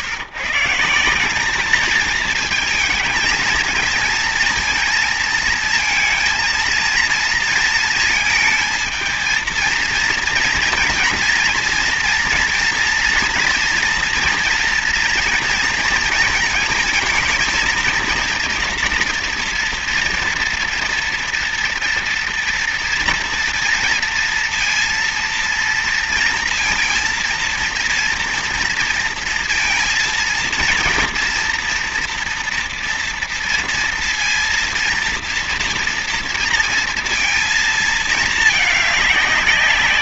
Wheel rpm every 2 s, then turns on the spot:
150, 230, 230, 230, 220, 230, 230, 230, 230, 230, 230, 230, 230, 230, 230, 230, 230, 230, 230, 210.
none